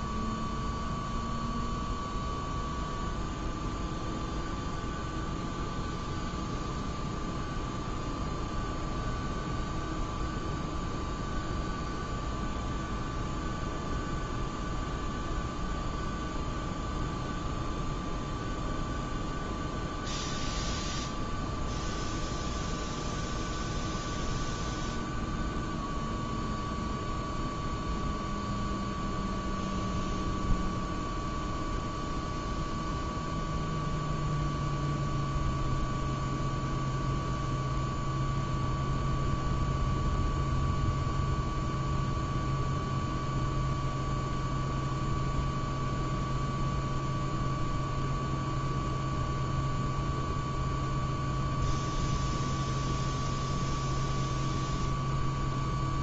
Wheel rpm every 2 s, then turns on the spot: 0, 0, 0, 0, 0, 0, 0, 0, 0, 0, 0, 0, 0, 0, 0, 0, 0, 0, 0, 0, 0, 0, 0, 0, 0, 0, 0, 0.
none